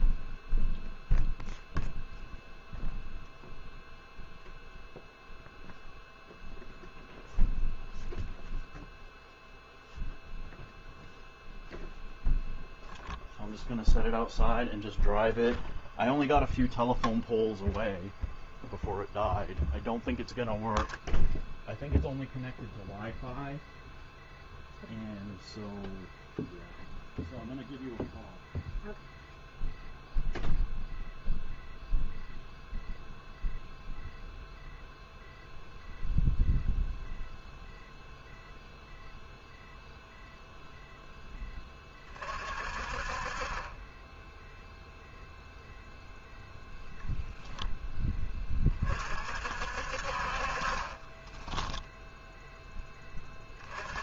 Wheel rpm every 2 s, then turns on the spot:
0, 0, 0, 0, 0, 0, 0, 0, 0, 0, 0, 0, 0, 0, 0, 0, 0, 0, 0, 0, 0, 40, 0, 0, 30, 30, 0.
none